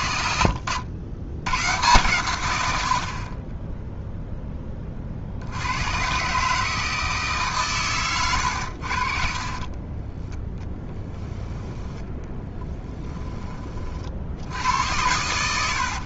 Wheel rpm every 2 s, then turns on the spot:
90, 70, 40, 160, 70, 10, 10, 90.
none